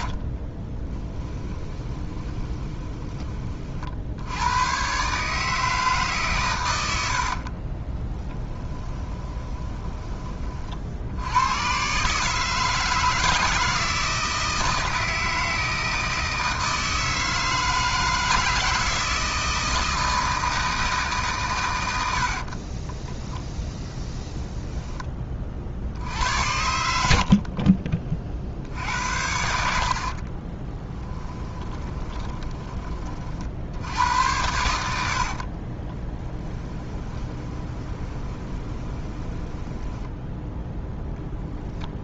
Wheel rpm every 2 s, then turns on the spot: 20, 20, 120, 120, 20, 50, 160, 160, 160, 160, 160, 30, 10, 80, 60, 20, 30, 80, 10, 20, 0.
0-4 8-10 22-24 30-32 36-40